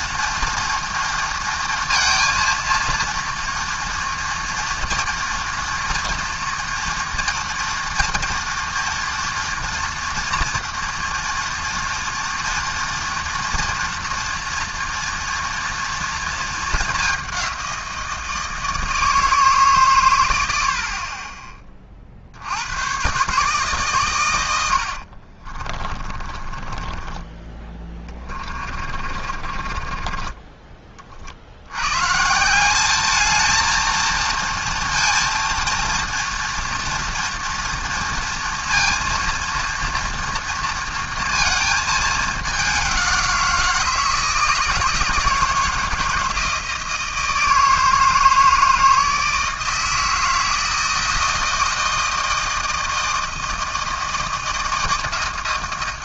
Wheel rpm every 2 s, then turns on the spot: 230, 230, 230, 230, 230, 240, 230, 230, 220, 160, 70, 100, 80, 20, 40, 30, 190, 230, 230, 230, 230, 200, 160, 160, 160, 160, 160, 160.
24-30